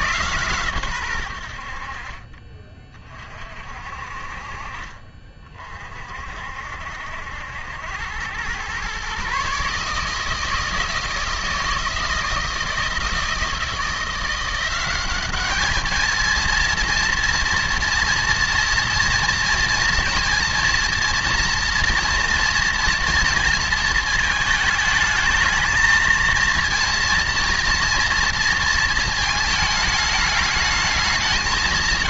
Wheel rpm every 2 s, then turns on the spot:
120, 30, 40, 60, 120, 160, 170, 180, 230, 230, 230, 230, 220, 230, 230, 210.
none